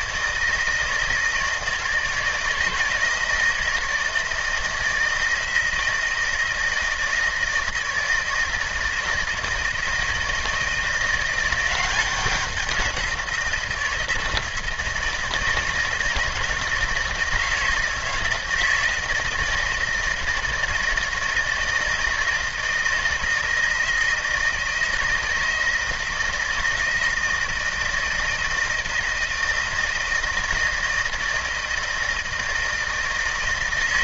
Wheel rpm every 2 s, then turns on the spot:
160, 160, 160, 160, 160, 170, 180, 160, 160, 160, 160, 160, 160, 160, 160, 160, 160.
none